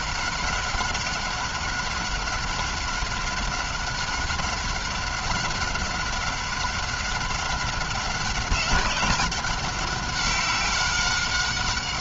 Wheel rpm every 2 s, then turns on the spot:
190, 190, 190, 190, 190, 190.
none